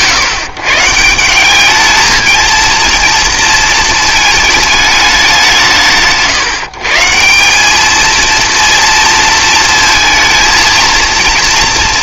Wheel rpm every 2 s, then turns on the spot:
140, 230, 210, 140, 230, 230.
none